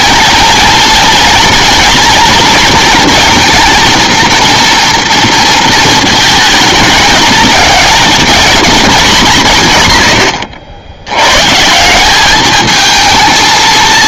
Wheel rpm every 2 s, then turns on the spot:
230, 230, 230, 220, 230, 100, 220.
none